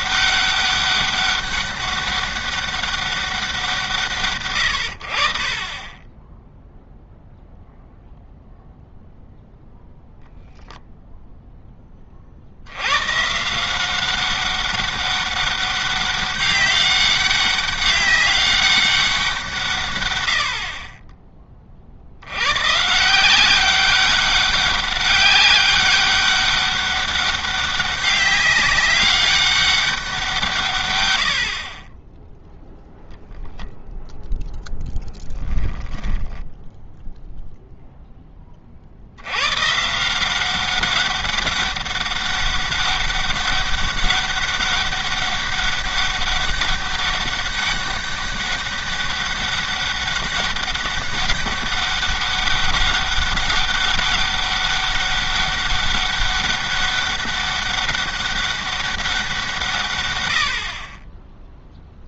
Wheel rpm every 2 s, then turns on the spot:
200, 200, 90, 0, 0, 0, 80, 200, 200, 200, 50, 130, 200, 200, 200, 150, 0, 0, 10, 30, 190, 200, 200, 200, 200, 200, 200, 200, 200, 200, 50.
36-38